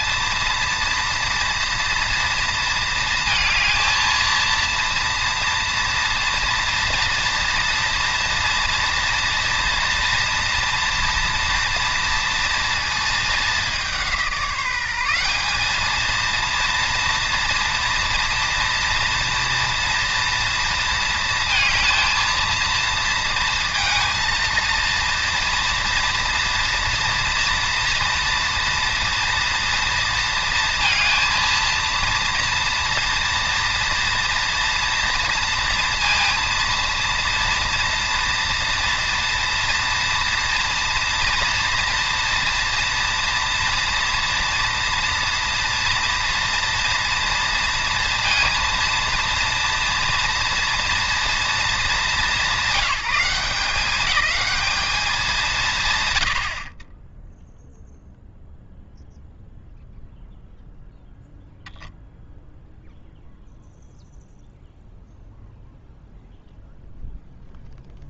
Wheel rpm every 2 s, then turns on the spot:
230, 230, 230, 230, 240, 240, 230, 180, 230, 240, 230, 230, 230, 230, 230, 230, 230, 240, 230, 230, 230, 230, 230, 230, 230, 240, 190, 220, 10, 0, 0, 0, 0, 0.
none